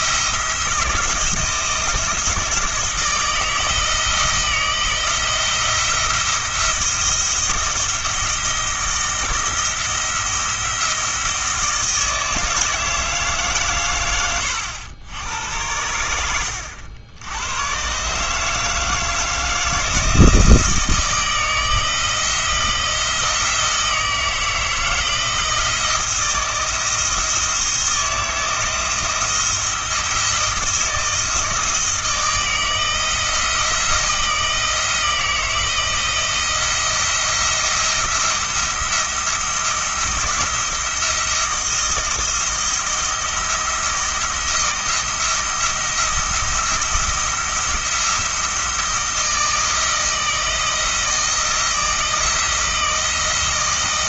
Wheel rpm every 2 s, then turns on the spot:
170, 170, 170, 170, 170, 170, 160, 100, 80, 160, 160, 170, 160, 170, 170, 170, 170, 160, 170, 170, 170, 170, 170, 170, 160, 160, 170.
none